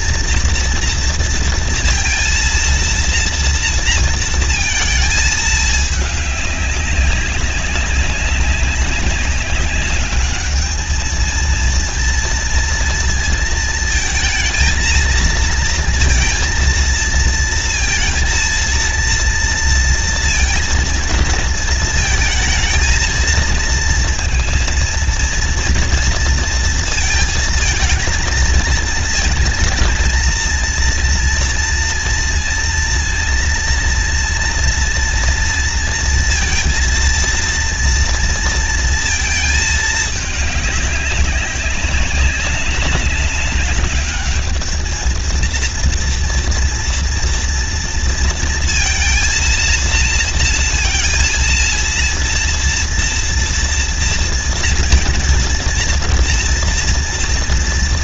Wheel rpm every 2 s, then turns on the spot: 230, 230, 230, 200, 200, 220, 230, 230, 230, 230, 230, 220, 230, 230, 220, 230, 230, 230, 230, 230, 200, 190, 220, 230, 230, 230, 230, 230, 230.
none